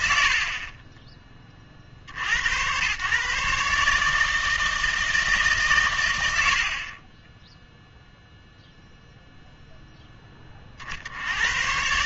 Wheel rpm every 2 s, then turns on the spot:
40, 100, 160, 40, 0, 40.
0-2 6-8